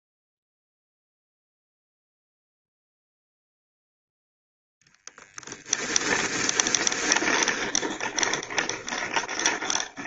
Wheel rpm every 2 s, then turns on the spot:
0, 0, 10, 20, 20.
6-10